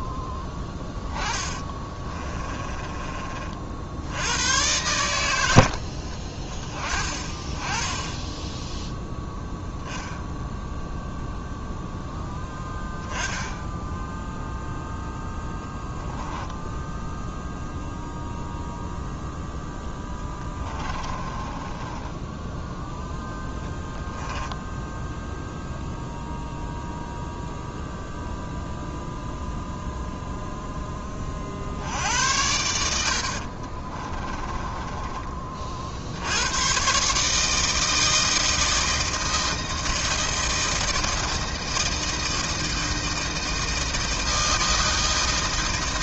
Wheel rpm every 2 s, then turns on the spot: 10, 20, 110, 30, 0, 0, 10, 0, 0, 0, 20, 0, 0, 0, 0, 10, 80, 20, 120, 160, 160, 160, 160.
0-4 20-22 34-36